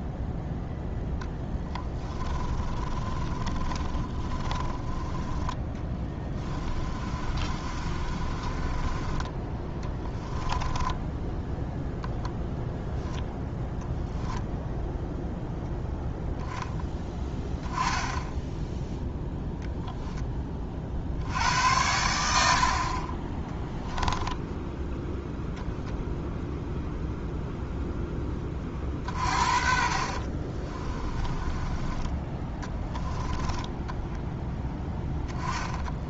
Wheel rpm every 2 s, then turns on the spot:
0, 20, 10, 30, 20, 10, 0, 0, 0, 0, 50, 50, 10, 0, 40, 30, 20, 10.
2-12 30-36